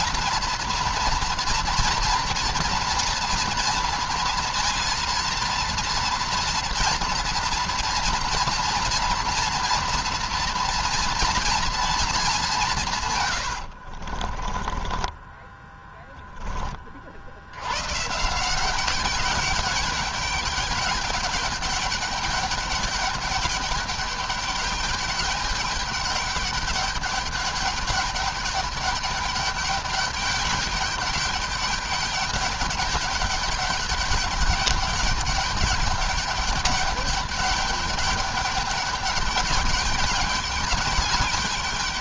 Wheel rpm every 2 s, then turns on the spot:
240, 230, 230, 230, 230, 230, 180, 30, 20, 180, 210, 210, 200, 200, 200, 210, 200, 200, 200, 200, 210.
14-16